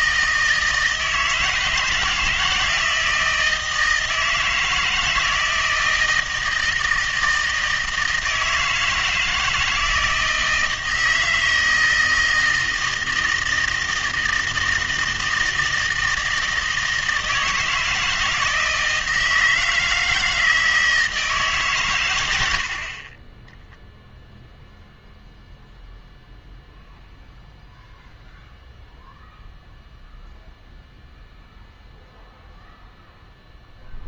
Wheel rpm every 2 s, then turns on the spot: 160, 170, 160, 160, 160, 160, 160, 160, 160, 160, 160, 60, 0, 0, 0, 0, 0.
none